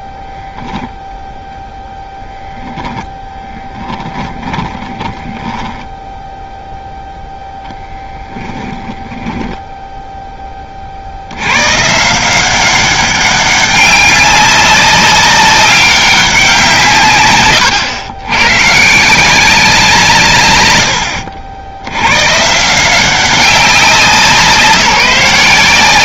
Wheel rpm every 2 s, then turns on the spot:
0, 10, 20, 0, 10, 20, 190, 200, 150, 160, 80, 170, 170.
4-6 8-10